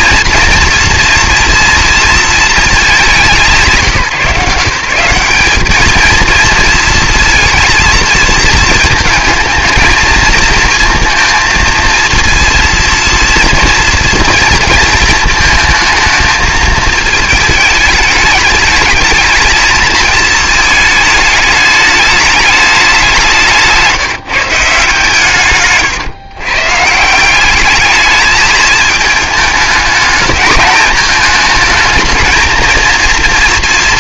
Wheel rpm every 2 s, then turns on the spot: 230, 210, 170, 230, 220, 230, 230, 230, 220, 210, 220, 190, 160, 150, 220, 220, 230.
none